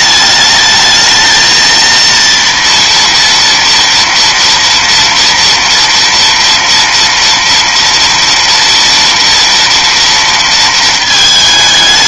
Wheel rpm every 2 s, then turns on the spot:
210, 230, 230, 230, 230, 230.
none